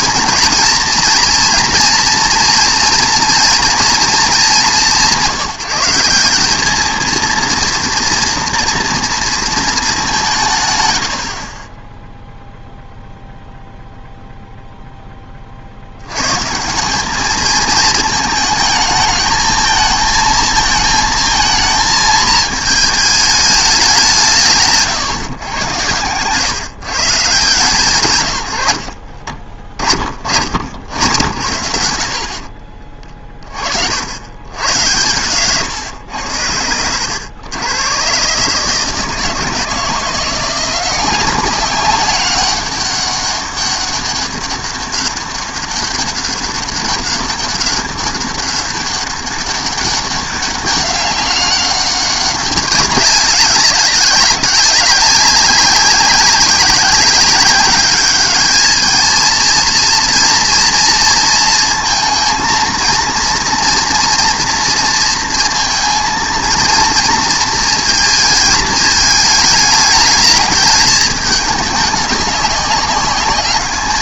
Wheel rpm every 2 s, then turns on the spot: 230, 230, 190, 210, 230, 120, 0, 0, 170, 220, 220, 220, 150, 140, 80, 90, 30, 110, 90, 150, 180, 200, 200, 200, 200, 200, 190, 190, 190, 220, 230, 230, 230, 230, 220, 210, 200.
none